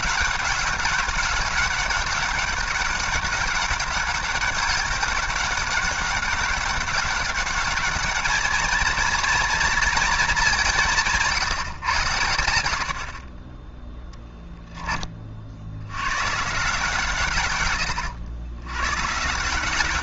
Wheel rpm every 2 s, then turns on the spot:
190, 200, 200, 200, 220, 190, 80, 10, 150, 130.
none